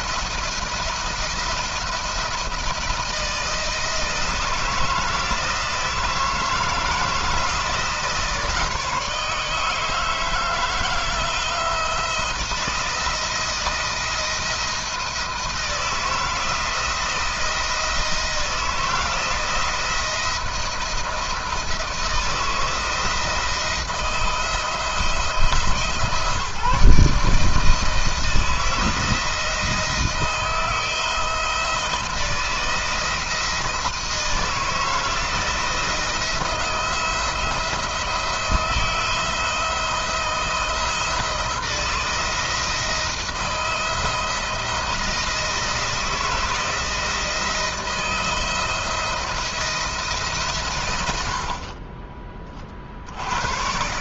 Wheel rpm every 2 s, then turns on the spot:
170, 170, 170, 170, 160, 160, 160, 170, 170, 170, 170, 160, 170, 160, 160, 160, 170, 160, 170, 170, 170, 160, 160, 170, 160, 120, 40.
none